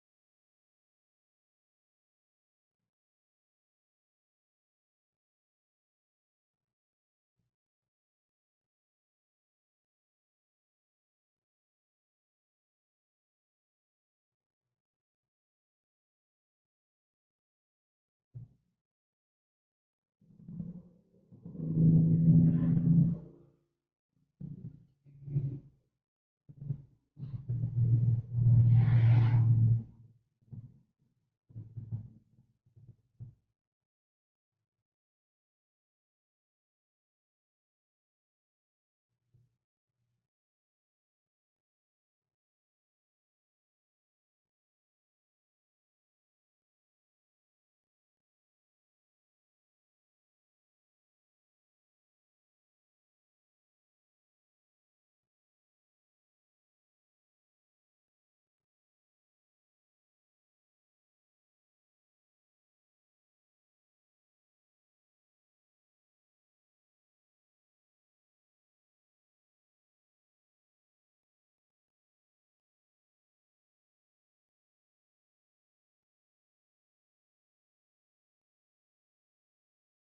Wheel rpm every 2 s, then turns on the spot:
0, 0, 0, 0, 0, 0, 0, 0, 0, 0, 0, 0, 0, 0, 0, 0, 0, 0, 0, 0, 0, 0, 0, 0, 0, 0, 0, 0, 0, 0, 0, 0, 0, 0, 0, 0, 0, 0, 0, 0.
none